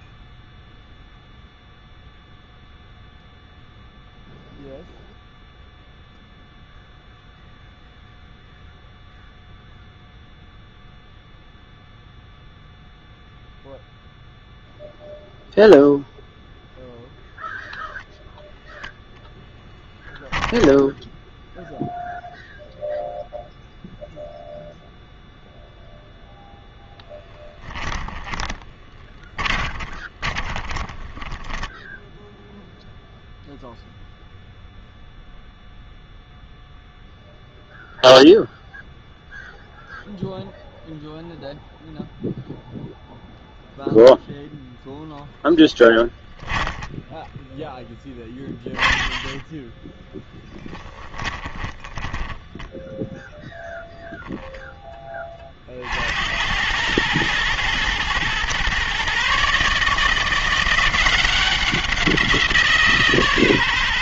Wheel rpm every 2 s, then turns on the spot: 0, 0, 0, 0, 0, 0, 0, 0, 0, 0, 0, 0, 0, 0, 20, 20, 0, 0, 0, 0, 0, 0, 0, 20, 20, 20, 10, 10, 100, 130, 180, 160.
28-32 46-54